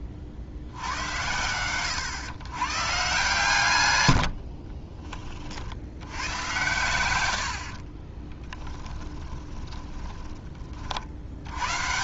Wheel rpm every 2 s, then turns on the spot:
40, 120, 40, 110, 10, 40.
4-10